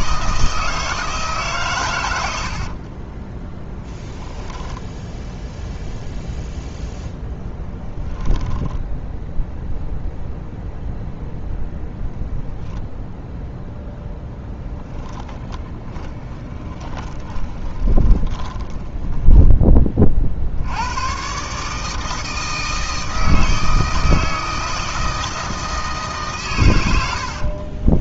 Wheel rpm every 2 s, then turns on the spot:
160, 50, 10, 0, 10, 0, 0, 10, 20, 10, 90, 160, 160, 100.
2-6 16-20